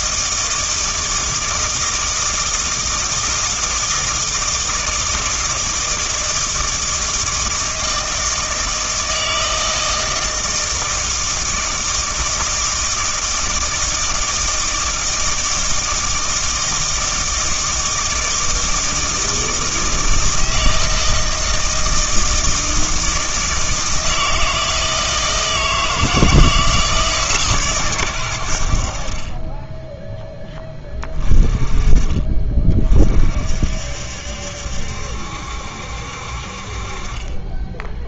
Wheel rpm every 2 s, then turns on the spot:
160, 160, 160, 160, 160, 160, 160, 160, 160, 160, 160, 160, 160, 160, 70, 30, 40, 70, 40.
none